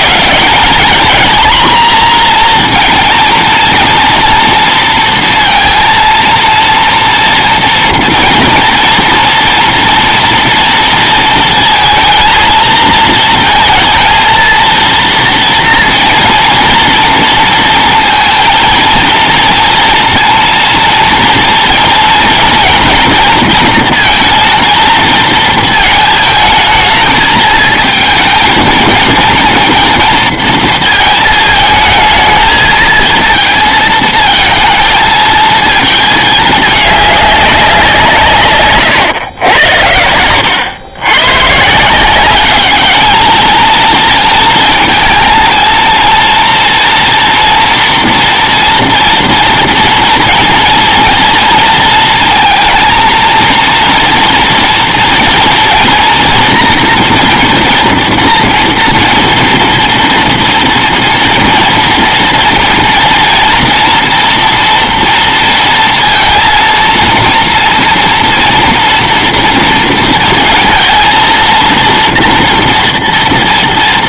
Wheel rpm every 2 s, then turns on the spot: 220, 230, 230, 230, 230, 230, 230, 230, 230, 230, 230, 230, 230, 220, 220, 230, 220, 220, 210, 140, 100, 200, 220, 230, 240, 240, 220, 240, 230, 240, 230, 230, 230, 230, 230, 230, 230.
none